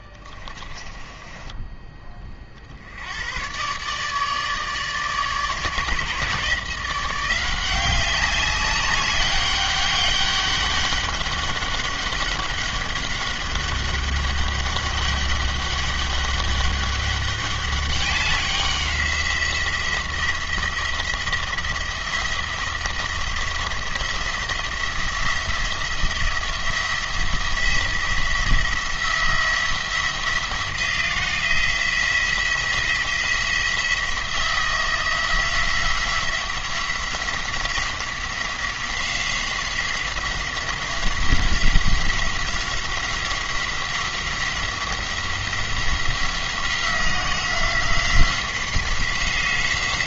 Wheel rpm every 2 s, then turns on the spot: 30, 60, 150, 170, 200, 200, 200, 200, 200, 190, 170, 170, 170, 170, 170, 170, 170, 170, 180, 180, 180, 180, 180, 180, 180.
0-2